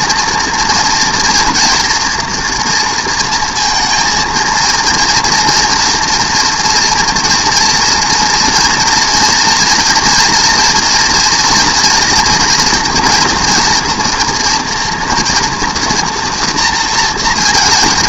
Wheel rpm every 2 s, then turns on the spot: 230, 240, 220, 240, 240, 230, 230, 230, 230.
none